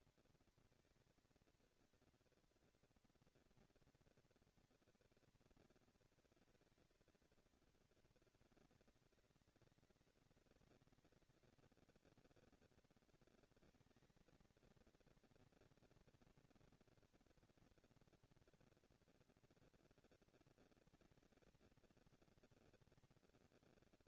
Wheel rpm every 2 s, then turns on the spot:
230, 230, 230, 220, 200, 190, 220, 230, 230, 230, 230, 230.
none